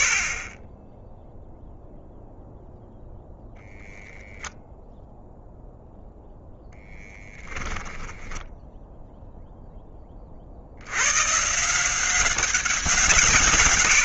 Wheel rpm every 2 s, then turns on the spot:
10, 0, 0, 0, 0, 90, 180.
none